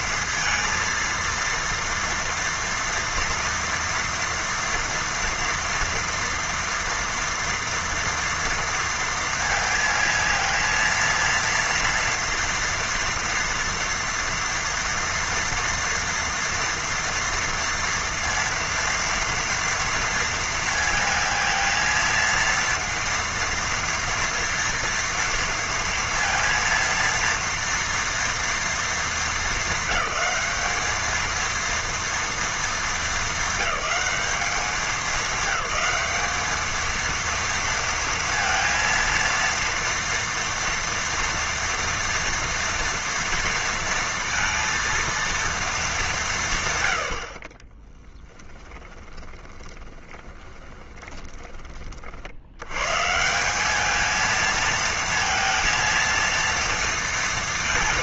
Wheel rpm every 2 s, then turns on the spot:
220, 230, 240, 230, 230, 230, 230, 230, 230, 230, 230, 230, 230, 230, 230, 200, 230, 210, 220, 230, 230, 240, 230, 130, 20, 20, 100, 230, 230.
48-52